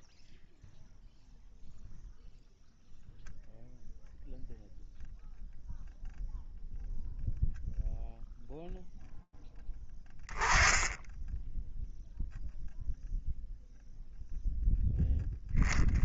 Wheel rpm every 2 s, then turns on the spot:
0, 0, 0, 0, 0, 10, 0, 0.
none